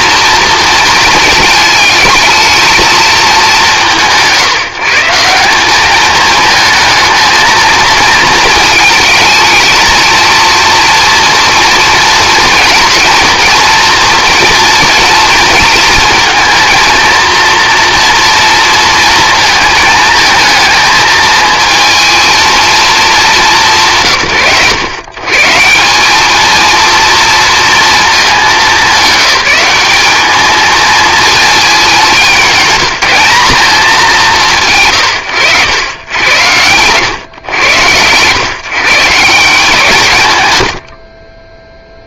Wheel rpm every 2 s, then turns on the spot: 230, 220, 150, 220, 220, 230, 230, 230, 230, 230, 220, 220, 90, 230, 200, 230, 200, 120, 110, 140, 100.
none